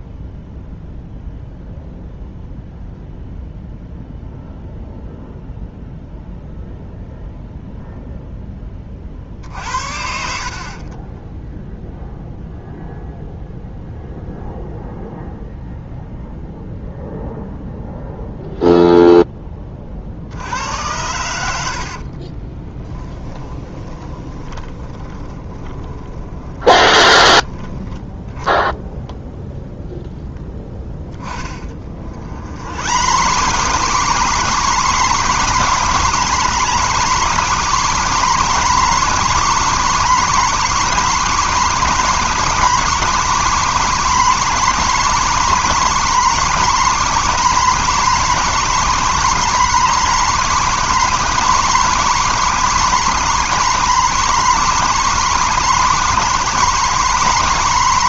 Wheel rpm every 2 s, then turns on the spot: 0, 0, 0, 0, 30, 40, 0, 0, 0, 0, 90, 20, 20, 20, 0, 10, 100, 150, 140, 150, 150, 150, 150, 140, 150, 150, 150, 140, 140.
10-12 22-28 30-58